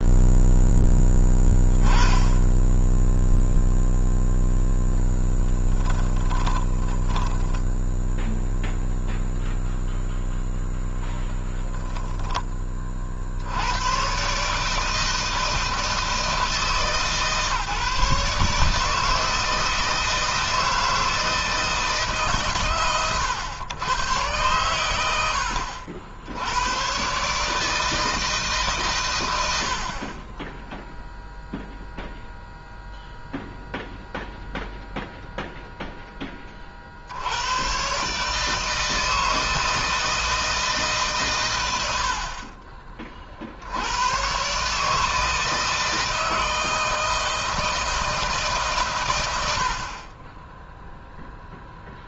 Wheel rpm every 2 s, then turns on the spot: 10, 10, 0, 10, 0, 0, 30, 160, 150, 160, 160, 120, 100, 110, 140, 10, 0, 0, 50, 160, 150, 30, 140, 160, 140, 10.
6-8